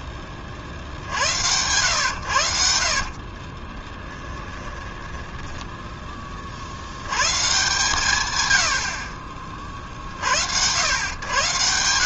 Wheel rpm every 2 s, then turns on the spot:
50, 70, 30, 80, 70, 100.
2-6